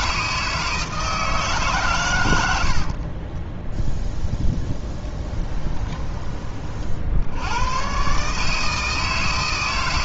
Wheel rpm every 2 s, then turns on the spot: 160, 50, 10, 60, 160.
2-6